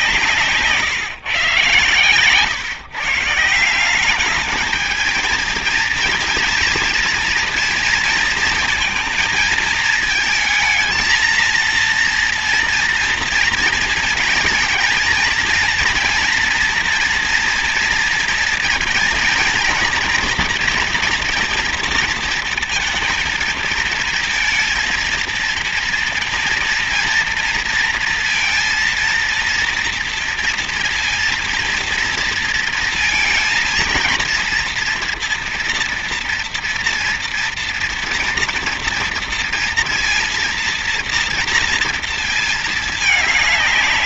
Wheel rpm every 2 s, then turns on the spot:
150, 140, 210, 230, 230, 220, 230, 220, 230, 230, 230, 230, 230, 230, 230, 230, 230, 230, 230, 230, 230, 220.
none